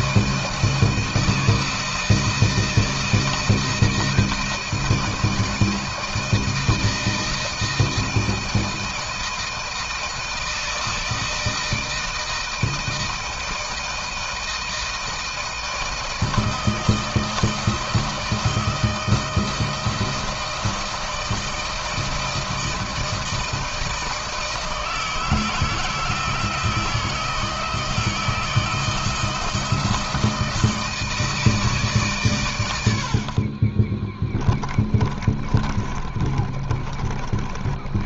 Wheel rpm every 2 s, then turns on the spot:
160, 160, 160, 160, 160, 160, 160, 160, 160, 160, 160, 160, 160, 160, 160, 160, 100, 30, 30.
34-38